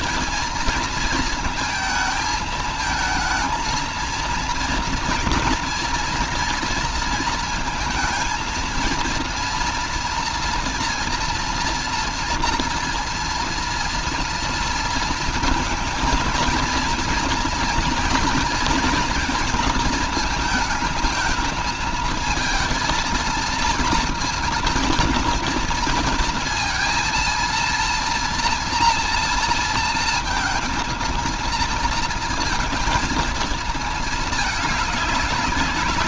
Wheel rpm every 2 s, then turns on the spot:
220, 220, 230, 230, 230, 230, 230, 230, 230, 220, 220, 220, 230, 230, 230, 230, 230, 210.
none